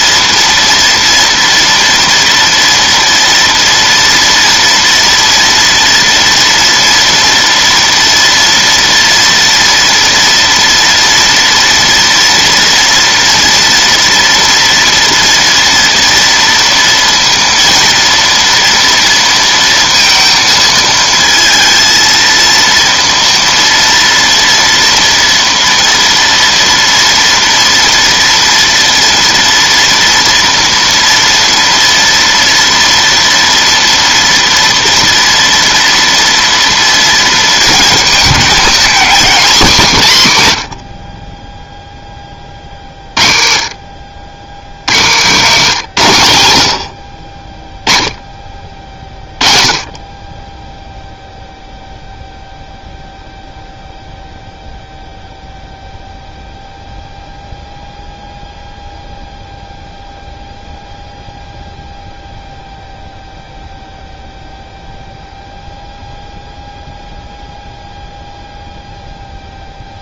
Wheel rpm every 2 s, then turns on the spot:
230, 230, 240, 230, 230, 230, 230, 230, 230, 230, 220, 230, 230, 230, 240, 230, 230, 240, 230, 220, 60, 40, 100, 50, 30, 0, 0, 0, 0, 0, 0, 0, 0, 0, 0.
44-46